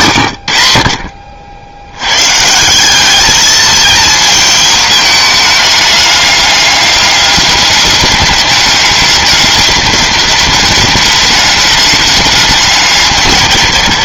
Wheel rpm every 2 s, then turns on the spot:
90, 160, 220, 200, 200, 200, 190.
none